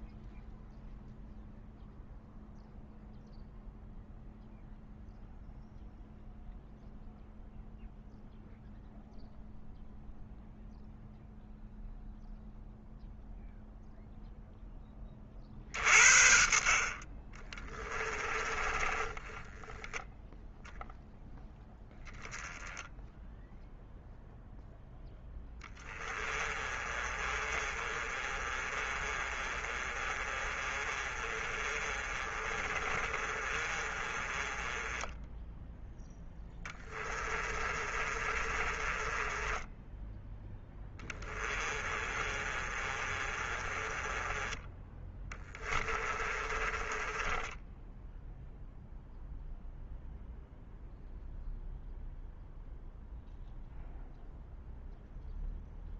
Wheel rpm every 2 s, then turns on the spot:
0, 0, 0, 0, 0, 0, 0, 10, 40, 20, 0, 0, 0, 20, 30, 30, 30, 20, 10, 30, 10, 30, 20, 20, 0, 0, 0, 0.
16-20 26-44 46-48